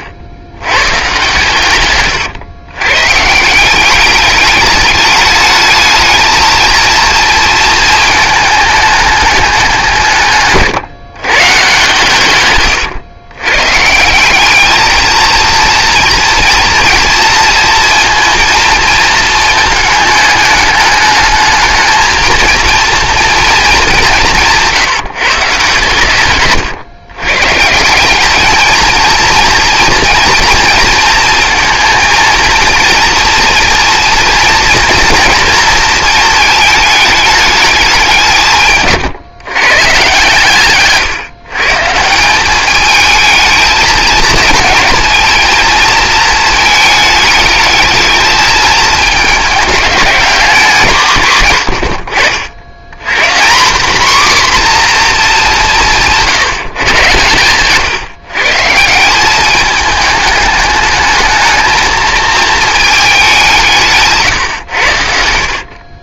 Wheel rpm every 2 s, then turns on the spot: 100, 110, 200, 220, 220, 140, 130, 200, 240, 230, 210, 230, 170, 140, 210, 230, 230, 230, 220, 170, 130, 190, 230, 230, 220, 190, 70, 260, 160, 140, 210, 220, 130.
12-14